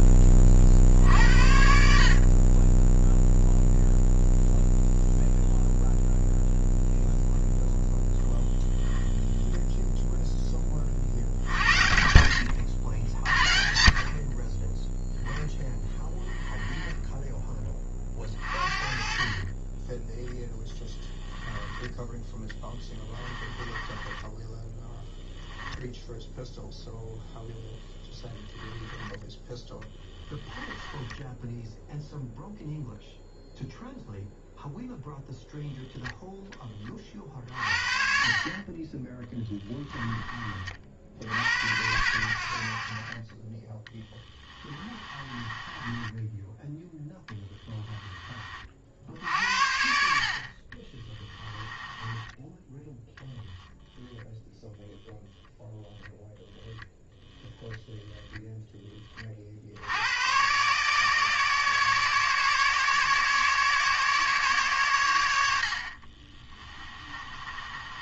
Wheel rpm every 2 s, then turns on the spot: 50, 10, 0, 0, 0, 40, 80, 10, 10, 40, 10, 20, 10, 0, 10, 10, 0, 0, 40, 20, 60, 50, 20, 0, 50, 30, 10, 0, 0, 20, 140, 150, 110, 20.
22-26 30-32 44-46 50-52 66-68